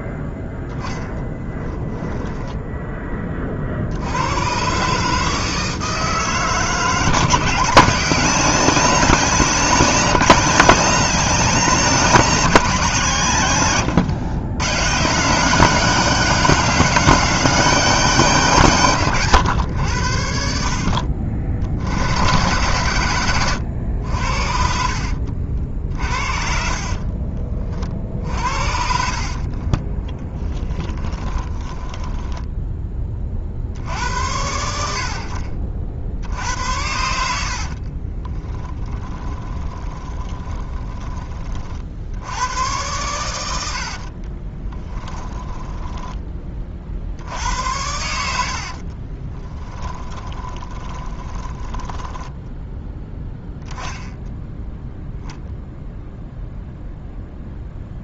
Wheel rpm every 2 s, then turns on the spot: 0, 10, 130, 160, 190, 190, 170, 130, 200, 150, 60, 110, 60, 50, 60, 10, 10, 70, 90, 20, 20, 100, 20, 40, 50, 20, 10, 0, 0.
24-32 38-42 44-46 48-52